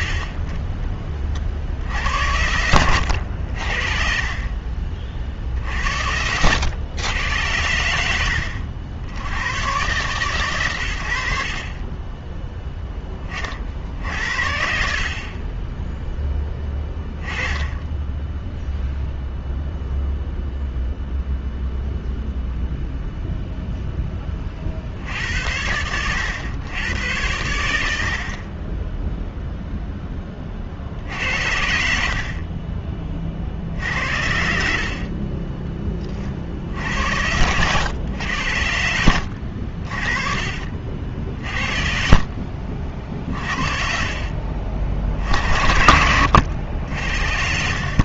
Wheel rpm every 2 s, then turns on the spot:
20, 90, 30, 80, 80, 120, 10, 60, 10, 0, 0, 0, 40, 100, 30, 50, 30, 60, 60, 90, 40, 60, 60, 90.
2-4 8-10 32-34 40-44